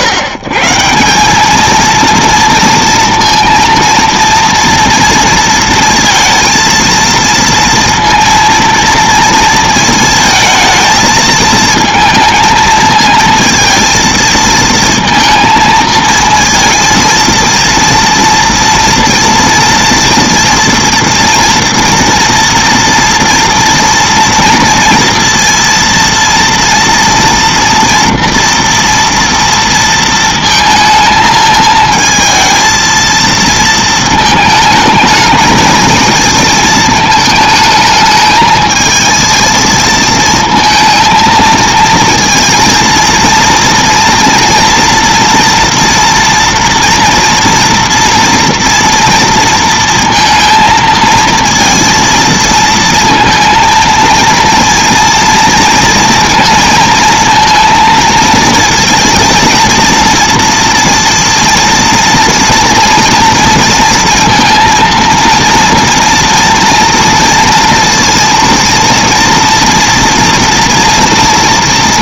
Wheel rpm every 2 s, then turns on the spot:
150, 230, 230, 230, 230, 220, 220, 230, 230, 230, 230, 230, 230, 230, 230, 220, 220, 220, 220, 220, 220, 230, 230, 230, 230, 230, 230, 230, 230, 230, 230, 230, 230, 230, 230, 230.
none